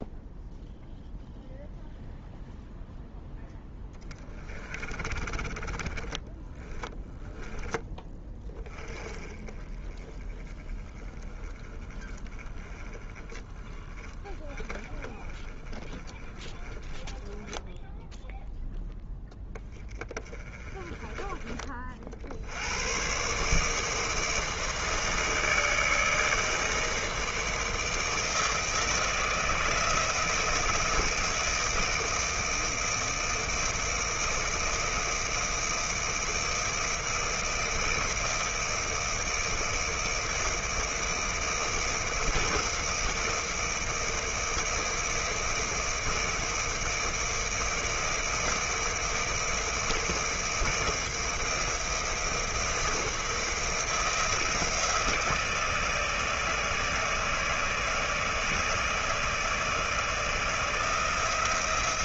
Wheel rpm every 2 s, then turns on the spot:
0, 0, 20, 20, 20, 20, 20, 30, 20, 0, 30, 100, 160, 160, 160, 160, 160, 160, 160, 160, 160, 160, 160, 160, 160, 160, 170, 160, 160, 160, 160.
4-8